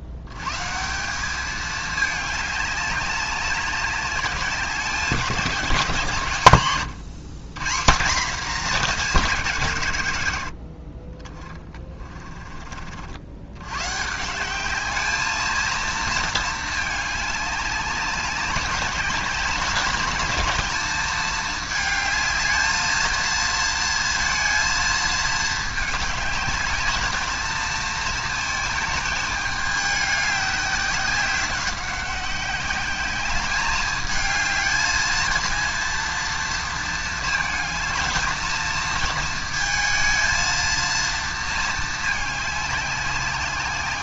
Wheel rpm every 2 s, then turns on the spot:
150, 200, 190, 120, 220, 60, 40, 200, 220, 200, 210, 220, 230, 210, 220, 190, 190, 220, 230, 220, 230, 200.
none